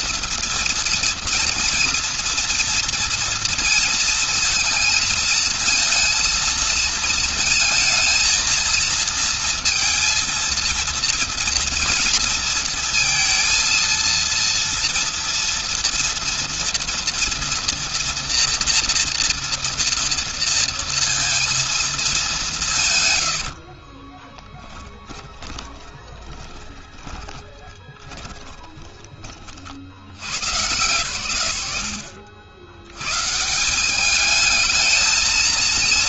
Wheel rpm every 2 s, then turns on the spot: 230, 230, 230, 230, 230, 230, 230, 230, 230, 230, 230, 180, 10, 20, 30, 140, 70, 210.
24-30